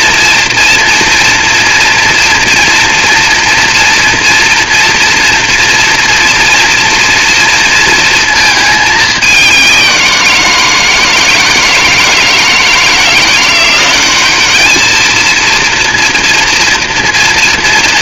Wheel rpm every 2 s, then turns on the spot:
230, 230, 230, 230, 220, 170, 160, 210, 230.
none